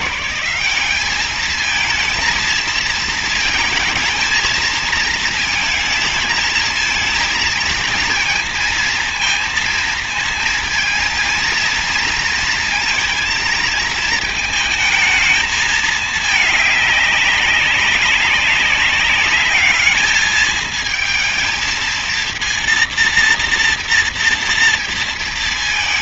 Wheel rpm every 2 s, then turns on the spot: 190, 230, 220, 230, 230, 230, 230, 220, 200, 200, 220, 240, 230.
none